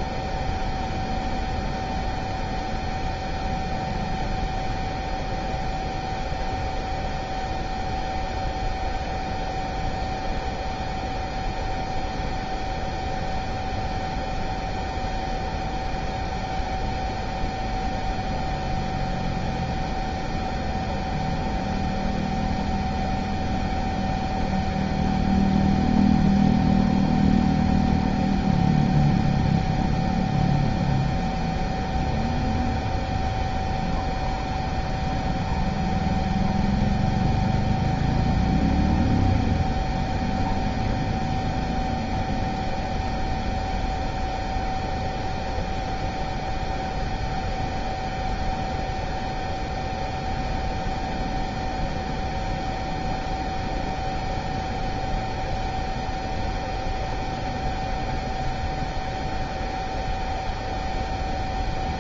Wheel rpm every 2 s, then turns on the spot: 0, 0, 0, 0, 0, 0, 0, 0, 0, 0, 0, 0, 0, 0, 0, 0, 0, 0, 0, 0, 0, 0, 0, 0, 0, 0, 0, 0, 0, 0, 0.
none